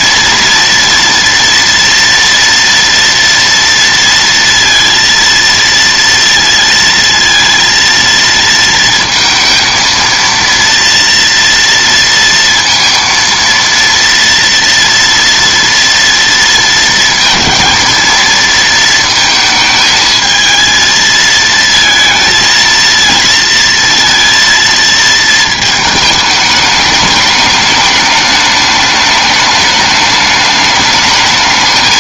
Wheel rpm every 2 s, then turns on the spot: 230, 230, 230, 230, 230, 230, 230, 230, 230, 230, 230, 230, 230, 210, 210, 210.
none